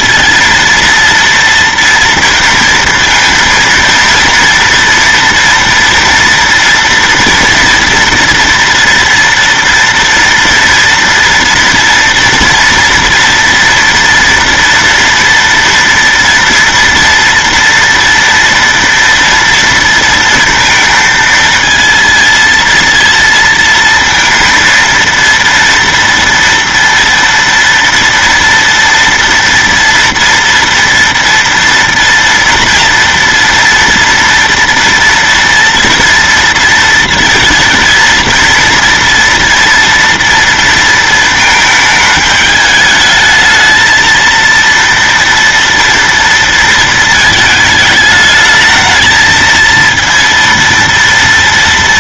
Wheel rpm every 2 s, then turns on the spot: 230, 230, 230, 230, 240, 230, 230, 230, 230, 230, 230, 230, 230, 230, 230, 230, 230, 230, 230, 230, 230, 210, 230, 230, 220, 230.
none